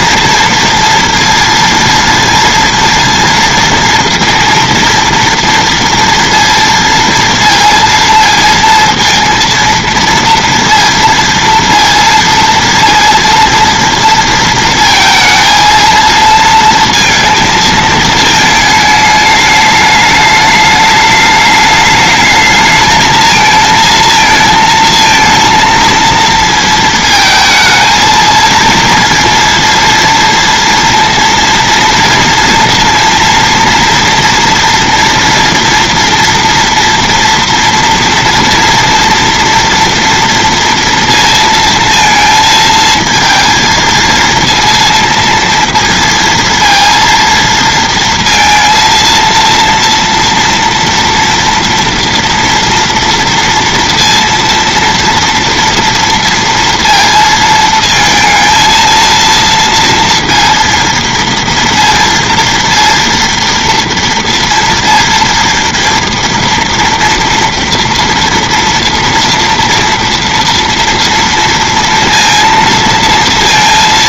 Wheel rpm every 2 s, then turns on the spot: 230, 230, 230, 230, 230, 230, 230, 230, 230, 220, 210, 220, 220, 220, 230, 230, 230, 240, 230, 230, 230, 230, 230, 230, 230, 230, 230, 230, 230, 230, 230, 230, 230, 230, 230, 230, 230.
none